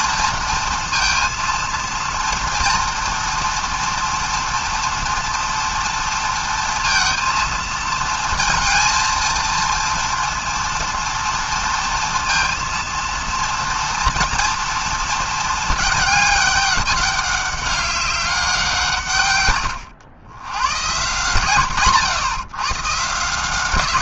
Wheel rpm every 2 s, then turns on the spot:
230, 230, 230, 230, 230, 230, 230, 230, 200, 170, 120, 150.
none